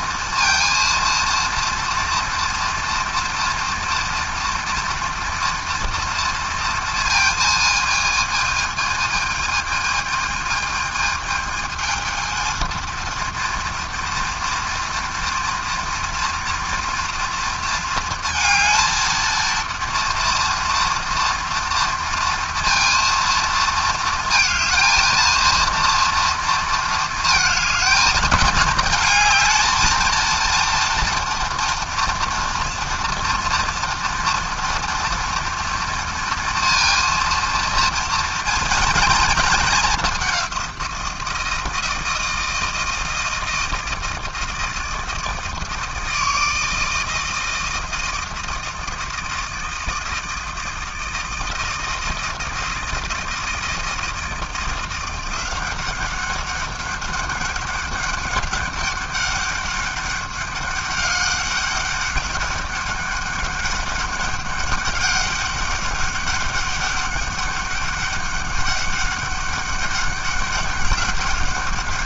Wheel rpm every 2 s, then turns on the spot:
230, 240, 230, 230, 220, 220, 230, 230, 230, 220, 230, 230, 230, 230, 220, 230, 230, 230, 230, 230, 180, 160, 160, 160, 160, 160, 160, 170, 190, 200, 200, 200, 200, 200, 200, 200.
none